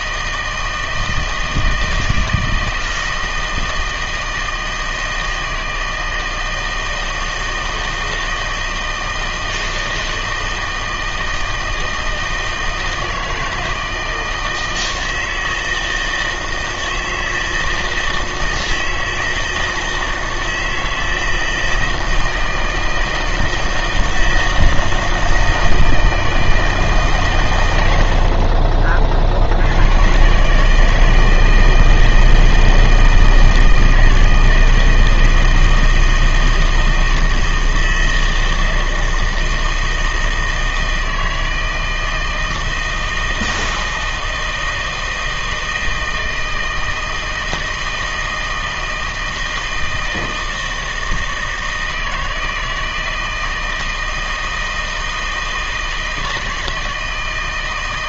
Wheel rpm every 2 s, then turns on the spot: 160, 160, 160, 160, 160, 160, 160, 160, 160, 160, 160, 160, 160, 160, 40, 150, 160, 160, 160, 160, 160, 160, 160, 160, 160, 160, 160, 160, 160.
none